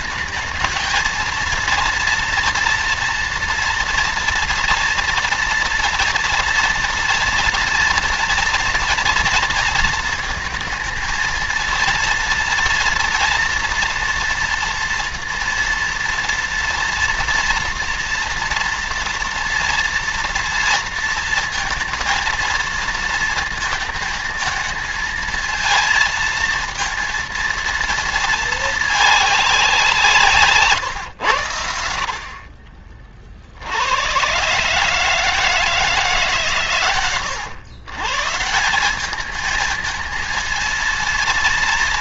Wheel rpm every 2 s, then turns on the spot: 230, 230, 230, 230, 230, 220, 240, 230, 230, 230, 230, 230, 220, 230, 220, 130, 40, 140, 130, 190, 230.
32-34